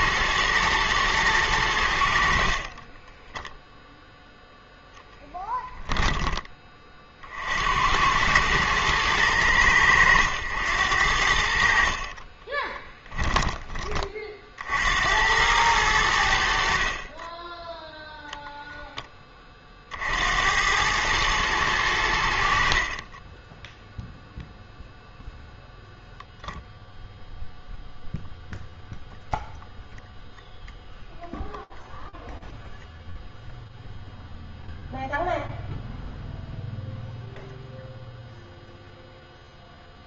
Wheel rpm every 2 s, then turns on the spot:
120, 50, 0, 20, 110, 90, 30, 50, 60, 0, 90, 60, 0, 0, 0, 0, 0, 0, 0, 0.
2-4 12-14